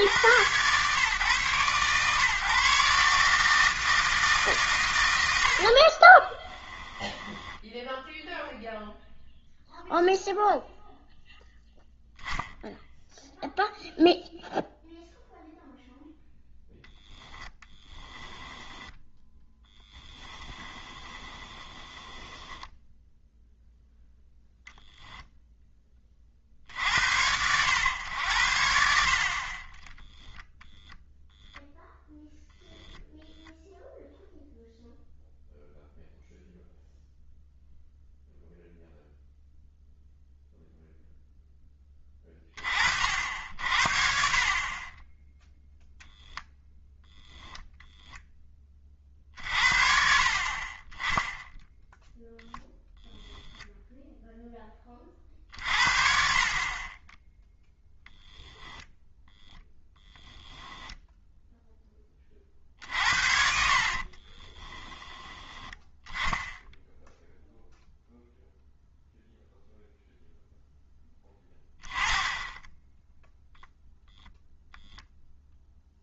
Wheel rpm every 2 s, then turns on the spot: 110, 140, 130, 10, 0, 0, 0, 0, 0, 10, 20, 10, 0, 60, 70, 10, 0, 0, 0, 0, 0, 40, 30, 10, 20, 30, 10, 20, 40, 0, 0, 50, 20, 10, 0, 0, 10, 0.
6-8 18-24 62-66